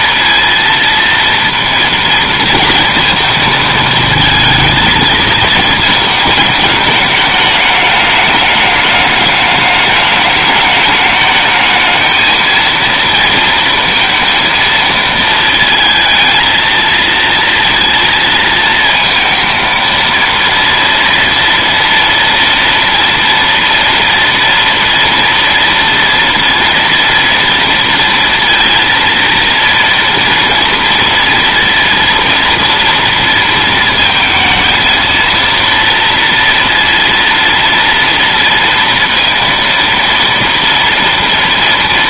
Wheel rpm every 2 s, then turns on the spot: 230, 230, 220, 220, 210, 210, 230, 230, 230, 230, 230, 230, 230, 230, 230, 230, 230, 230, 230, 230, 230.
none